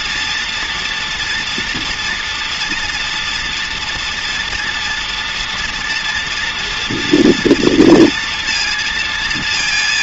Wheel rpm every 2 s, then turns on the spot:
230, 230, 230, 240, 230.
none